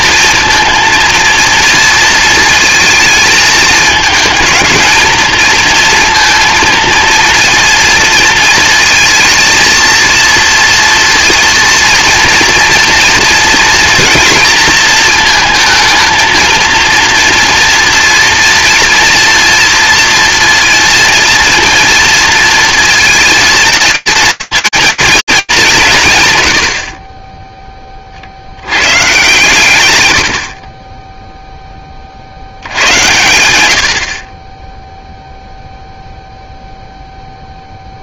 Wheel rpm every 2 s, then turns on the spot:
230, 220, 220, 230, 220, 230, 240, 230, 230, 240, 230, 230, 230, 110, 100, 50, 90, 0, 0.
none